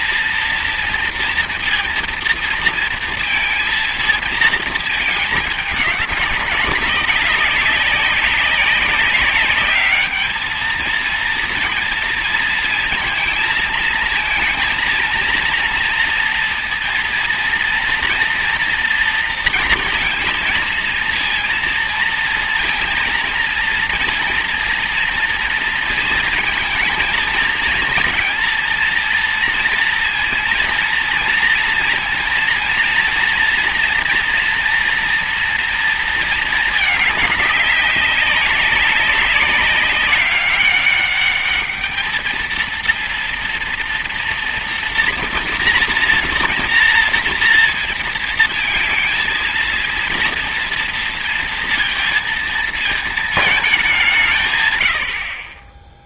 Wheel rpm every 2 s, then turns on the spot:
230, 230, 220, 200, 200, 220, 230, 230, 230, 230, 230, 230, 230, 220, 230, 230, 230, 240, 220, 200, 200, 230, 240, 230, 230, 230, 220, 110.
none